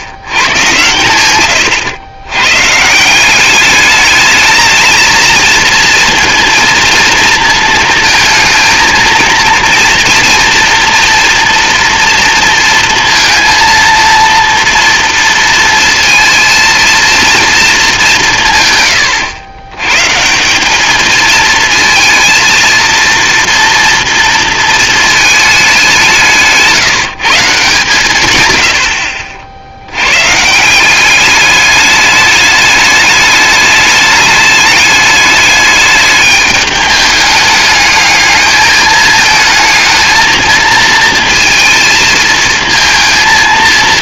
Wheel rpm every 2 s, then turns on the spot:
110, 140, 220, 230, 220, 230, 230, 230, 230, 110, 210, 230, 230, 170, 90, 180, 210, 210, 210, 210, 220, 230.
none